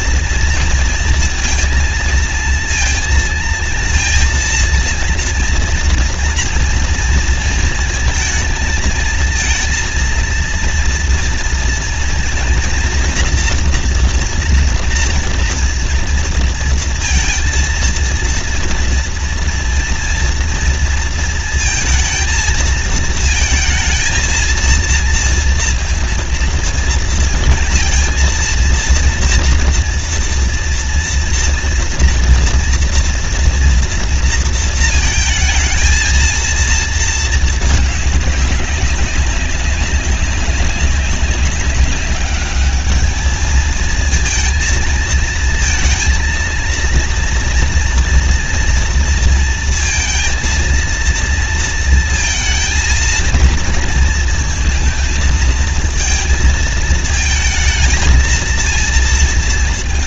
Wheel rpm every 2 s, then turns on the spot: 230, 230, 230, 230, 230, 230, 230, 230, 230, 230, 230, 220, 230, 230, 230, 230, 230, 230, 230, 200, 190, 210, 230, 230, 230, 230, 230, 230, 220, 220.
none